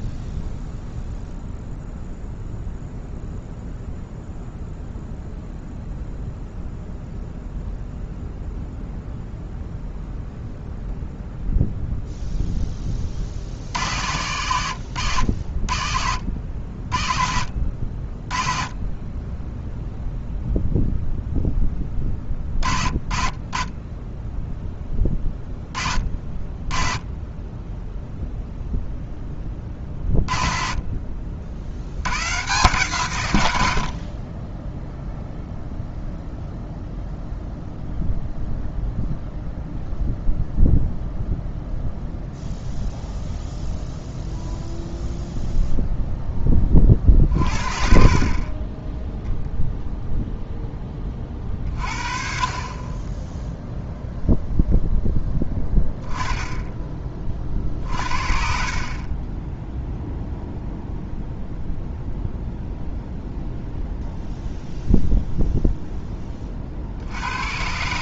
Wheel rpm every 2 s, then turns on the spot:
0, 0, 0, 0, 0, 0, 10, 90, 70, 20, 0, 30, 10, 20, 0, 30, 140, 10, 0, 0, 0, 0, 0, 20, 20, 10, 30, 0, 10, 40, 0, 0, 0, 40.
none